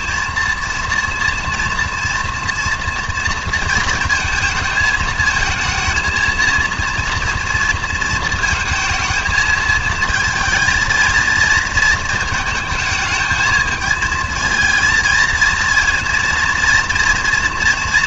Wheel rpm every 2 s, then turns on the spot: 230, 230, 220, 230, 230, 230, 220, 230, 230.
none